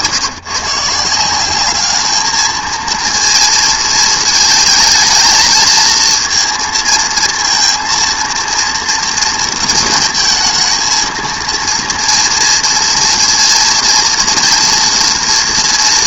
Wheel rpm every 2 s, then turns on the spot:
140, 220, 220, 230, 230, 220, 230, 230.
none